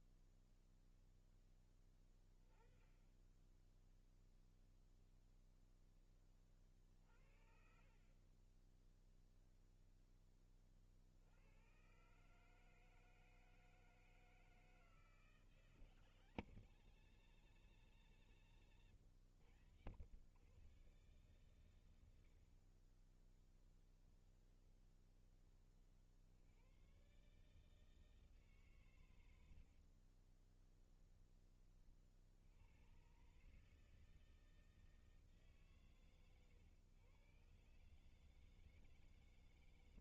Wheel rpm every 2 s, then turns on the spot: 0, 10, 0, 40, 10, 50, 160, 160, 180, 140, 120, 40, 20, 120, 130, 20, 100, 160, 110, 160.
18-20 24-26 30-32